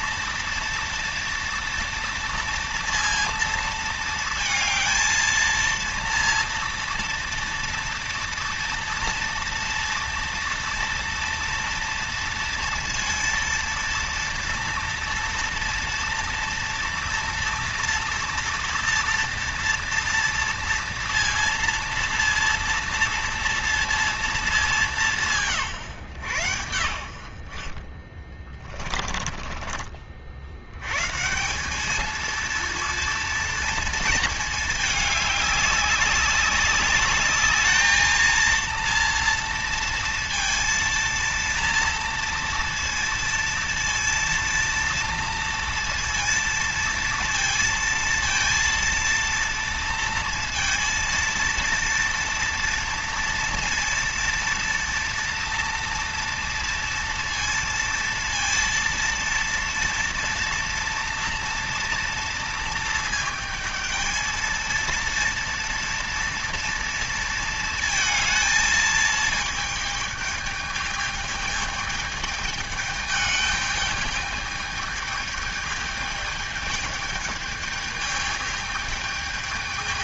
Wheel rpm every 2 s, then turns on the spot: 230, 230, 230, 230, 230, 230, 230, 230, 230, 230, 230, 230, 190, 70, 30, 130, 230, 210, 200, 230, 230, 230, 230, 230, 230, 230, 230, 230, 230, 230, 230, 220, 230, 230, 220, 210, 210, 210, 210, 210.
28-30